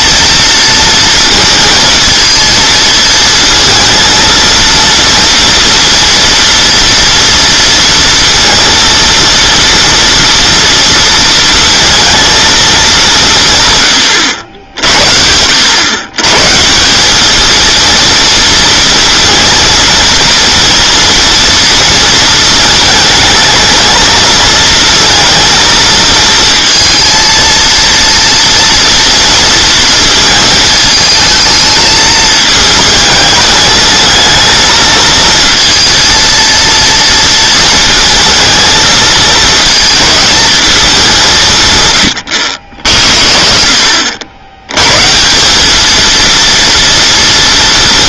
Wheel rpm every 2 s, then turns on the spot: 230, 230, 230, 230, 230, 230, 220, 80, 150, 230, 230, 220, 220, 230, 230, 220, 220, 230, 230, 230, 220, 60, 100, 230.
none